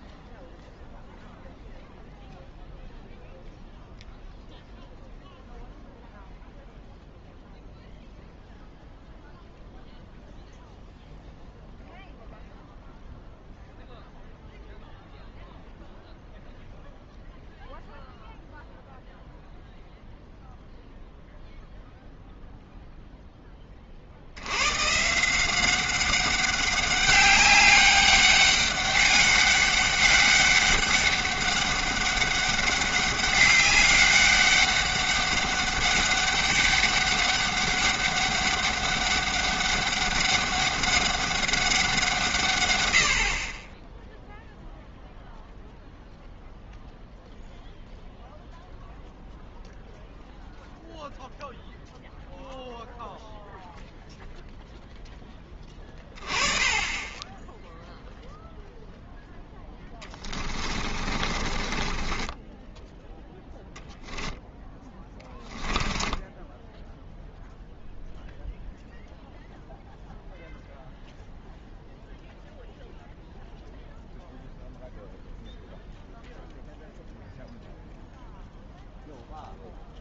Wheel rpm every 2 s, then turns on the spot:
0, 0, 0, 0, 0, 0, 0, 0, 0, 0, 0, 0, 120, 200, 200, 200, 200, 200, 200, 190, 200, 100, 0, 0, 0, 0, 0, 0, 20, 0, 30, 10, 10, 10, 0, 0, 0, 0, 0, 0.
60-68